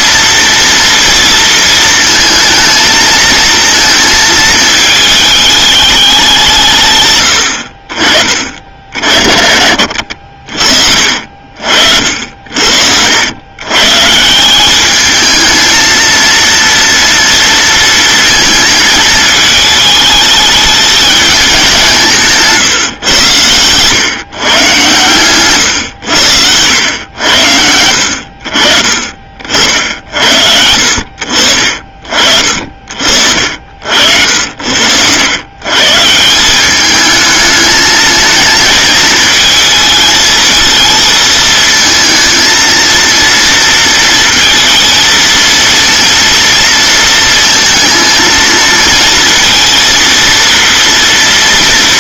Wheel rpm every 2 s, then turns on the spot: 230, 220, 220, 150, 50, 50, 70, 200, 230, 220, 210, 140, 120, 100, 40, 80, 60, 80, 200, 220, 220, 230, 230, 230, 230, 230.
10-12 28-30